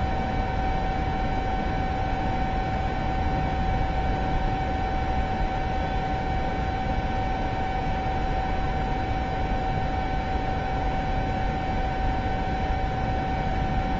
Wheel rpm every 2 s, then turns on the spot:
0, 0, 0, 0, 0, 0, 0.
none